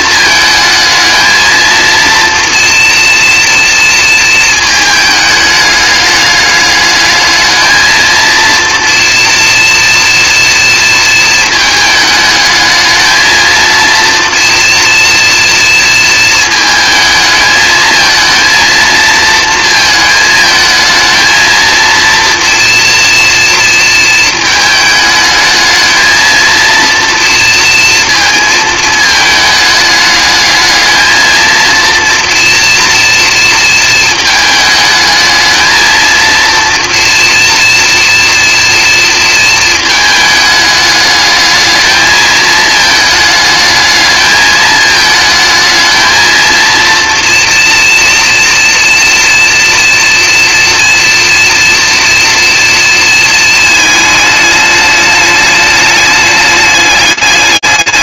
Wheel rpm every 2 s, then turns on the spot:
220, 230, 220, 210, 230, 230, 220, 230, 220, 230, 220, 240, 220, 230, 220, 220, 230, 220, 240, 230, 210, 220, 220, 230, 230, 230, 230, 210, 200.
none